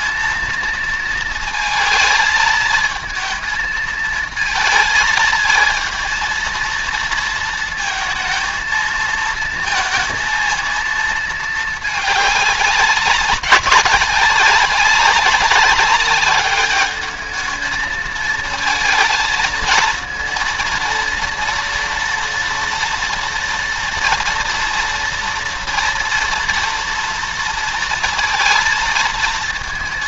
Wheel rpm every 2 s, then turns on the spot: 230, 220, 220, 230, 230, 220, 190, 190, 210, 220, 230, 230, 230, 230, 230.
none